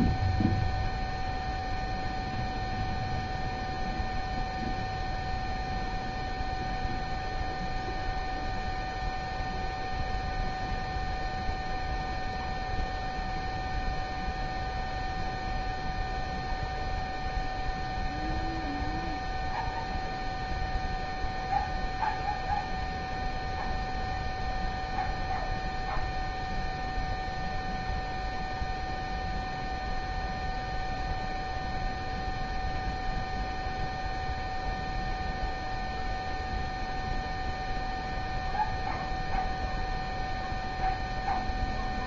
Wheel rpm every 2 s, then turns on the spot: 0, 0, 0, 0, 0, 0, 0, 0, 0, 0, 0, 0, 0, 0, 0, 0, 0, 0, 0, 0, 0.
none